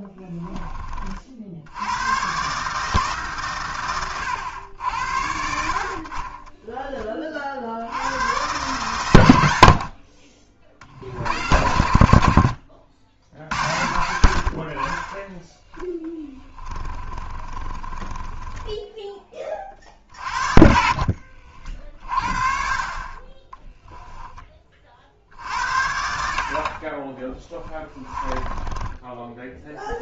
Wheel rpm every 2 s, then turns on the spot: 20, 150, 90, 20, 120, 50, 80, 50, 20, 20, 50, 40, 30, 40, 20.
16-22